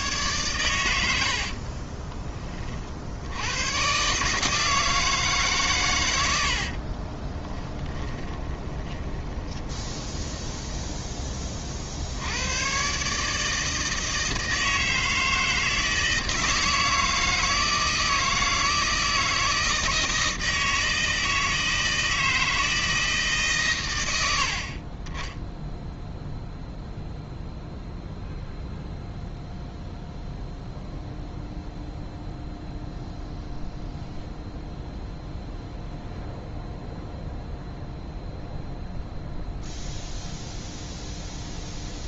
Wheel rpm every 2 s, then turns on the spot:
90, 50, 160, 50, 20, 10, 130, 160, 160, 160, 160, 160, 30, 0, 0, 0, 0, 0, 0, 0, 0.
6-10